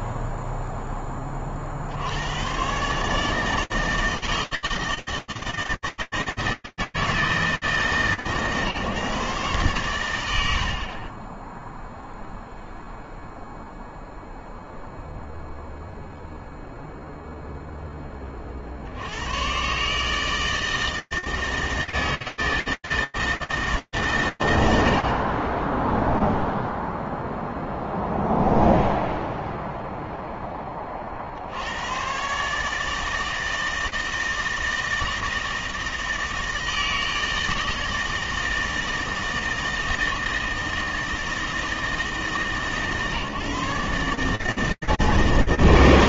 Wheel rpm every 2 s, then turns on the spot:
0, 80, 160, 160, 150, 90, 0, 0, 0, 90, 160, 160, 60, 0, 0, 60, 160, 160, 160, 160, 160, 150, 160.
none